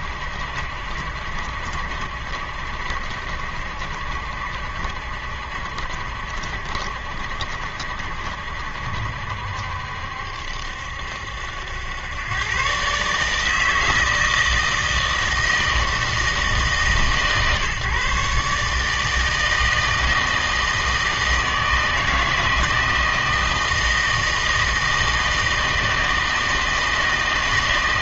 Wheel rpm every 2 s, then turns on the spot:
70, 70, 70, 70, 70, 70, 130, 160, 150, 150, 160, 160, 160, 160.
none